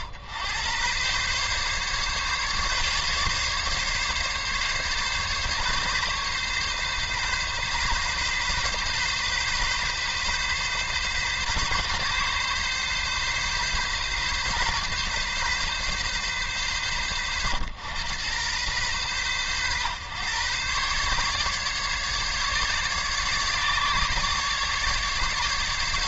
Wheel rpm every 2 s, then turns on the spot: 120, 140, 140, 140, 130, 130, 140, 130, 110, 120, 130, 140, 140.
none